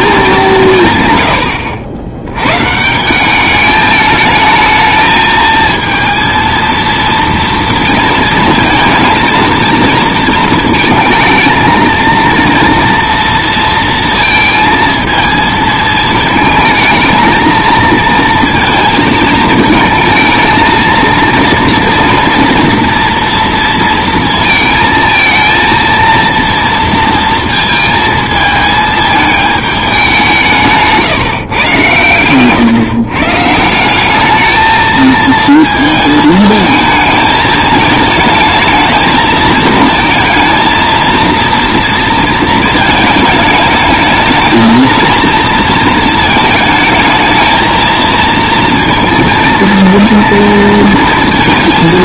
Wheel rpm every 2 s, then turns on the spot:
190, 120, 220, 230, 230, 220, 230, 230, 220, 230, 230, 230, 230, 230, 220, 170, 130, 210, 220, 220, 220, 220, 220, 220, 230, 230.
none